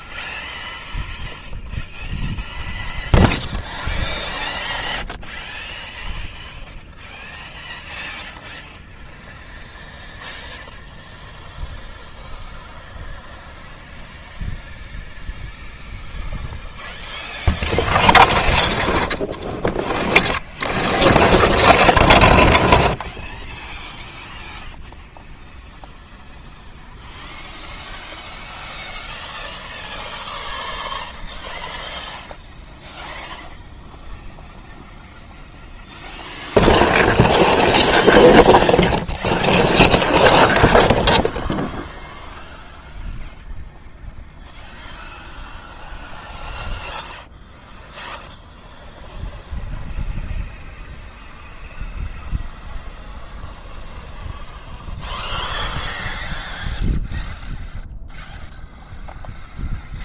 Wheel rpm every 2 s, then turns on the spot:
0, 0, 0, 0, 0, 0, 0, 0, 0, 0, 0, 0, 0, 0, 0, 0, 0, 0, 0, 0, 0, 0, 0, 0, 0, 0, 0, 0, 0, 0.
none